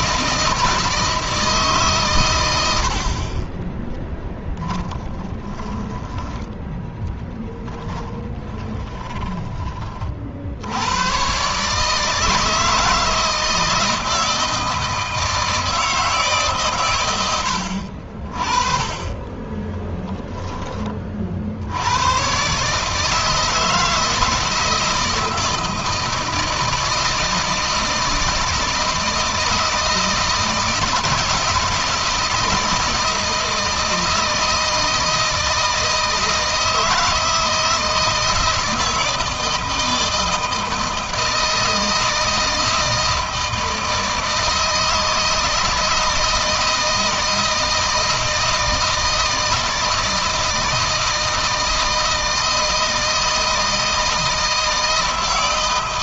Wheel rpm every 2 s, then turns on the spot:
160, 90, 10, 10, 20, 90, 160, 160, 120, 40, 30, 140, 160, 160, 160, 170, 160, 160, 160, 160, 160, 160, 160, 160, 160, 160, 160, 160.
4-6 8-10